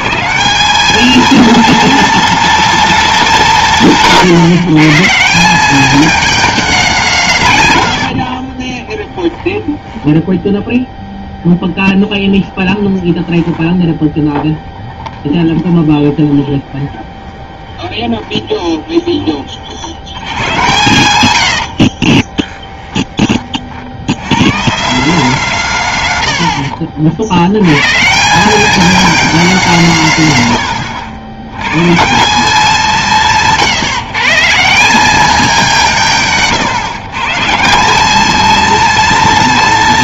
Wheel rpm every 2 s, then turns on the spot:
180, 230, 140, 220, 40, 0, 10, 30, 20, 20, 100, 20, 150, 80, 210, 110, 180, 170, 150, 220.
8-10 12-20 22-24 26-28